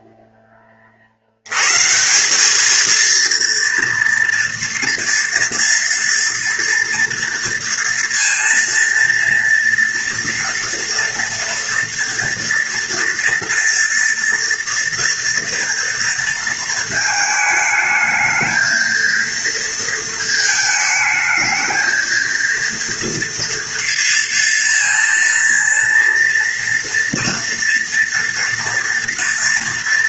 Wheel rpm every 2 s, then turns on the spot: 20, 200, 230, 230, 230, 230, 230, 240, 230, 220, 220, 230, 230, 230, 230.
none